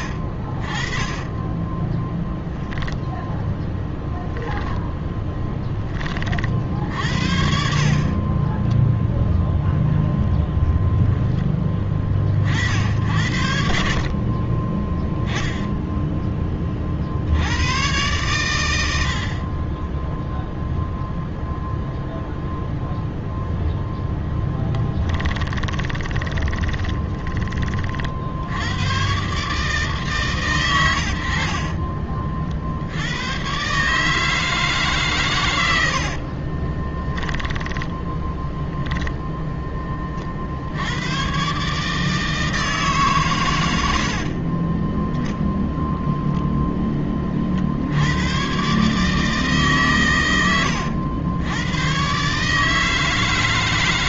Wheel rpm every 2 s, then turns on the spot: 20, 10, 10, 70, 0, 10, 60, 10, 50, 100, 0, 0, 10, 10, 100, 120, 80, 150, 30, 0, 70, 160, 20, 10, 130, 100, 150.
0-2 4-6 24-28 36-38